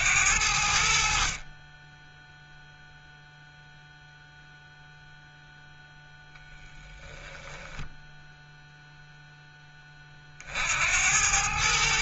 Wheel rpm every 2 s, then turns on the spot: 80, 0, 0, 0, 0, 60.
none